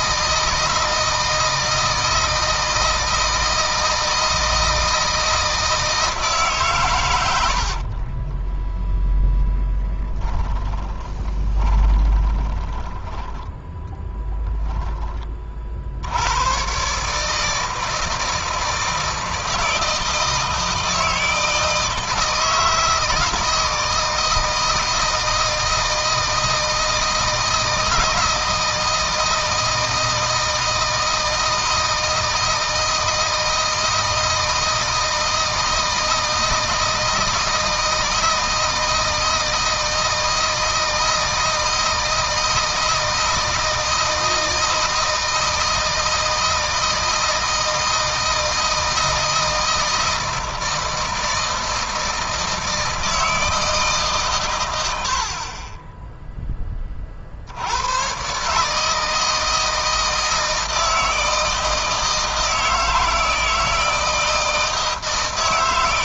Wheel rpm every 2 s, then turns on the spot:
160, 160, 160, 130, 0, 10, 20, 20, 130, 160, 160, 160, 160, 160, 160, 160, 160, 160, 160, 160, 160, 160, 160, 160, 160, 160, 160, 90, 20, 150, 160, 160, 160.
10-14